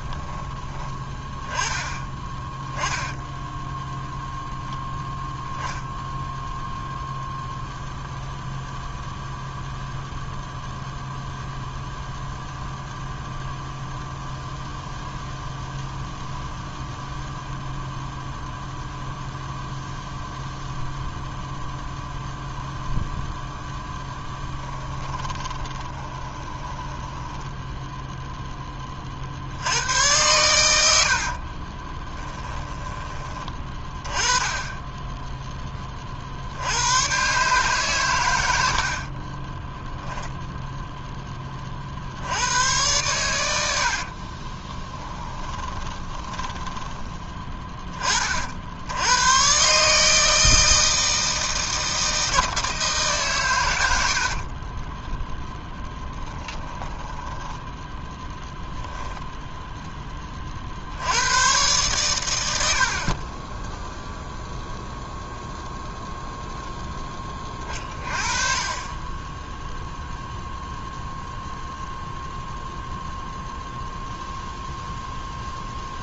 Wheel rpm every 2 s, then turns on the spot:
20, 10, 0, 0, 0, 0, 0, 0, 0, 0, 0, 0, 10, 10, 30, 80, 10, 10, 100, 60, 10, 100, 10, 20, 80, 160, 160, 20, 10, 0, 70, 60, 0, 10, 20, 0, 0, 0.
24-28 44-48 54-58